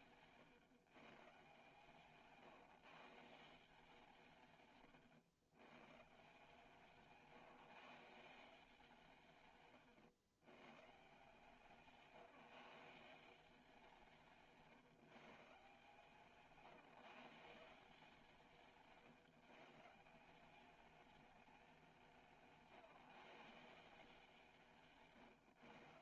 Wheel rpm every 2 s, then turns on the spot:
140, 140, 130, 150, 170, 120, 160, 160, 150, 160, 200, 170, 160.
18-20